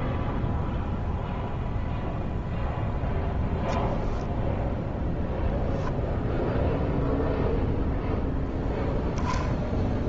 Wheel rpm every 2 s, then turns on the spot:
0, 0, 0, 0, 0.
none